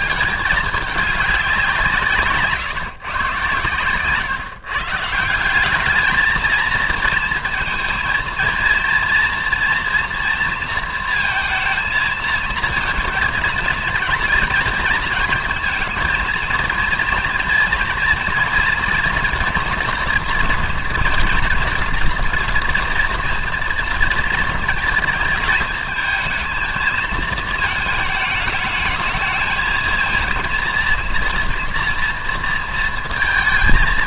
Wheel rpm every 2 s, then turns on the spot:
210, 150, 140, 220, 230, 230, 230, 230, 220, 230, 230, 230, 230, 220, 220, 230, 230.
none